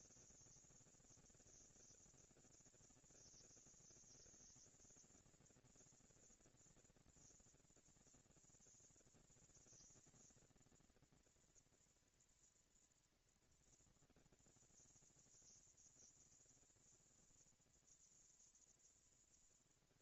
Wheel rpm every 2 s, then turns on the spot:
230, 240, 230, 230, 230, 230, 230, 230, 230, 230.
none